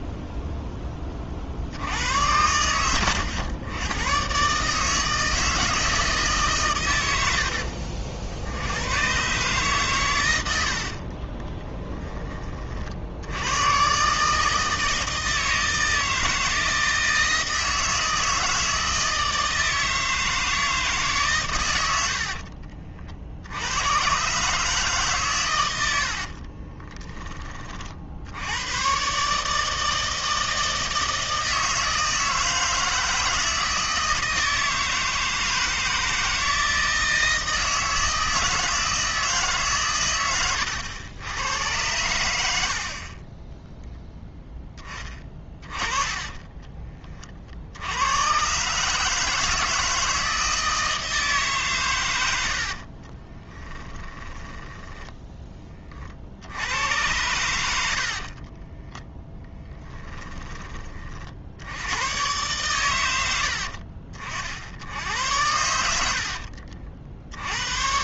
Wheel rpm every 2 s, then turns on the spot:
10, 90, 150, 120, 100, 70, 40, 160, 160, 160, 160, 40, 150, 30, 110, 160, 160, 160, 160, 160, 90, 40, 10, 20, 130, 160, 60, 10, 90, 20, 20, 120, 70, 50.
10-12 22-24 26-28 52-54 58-60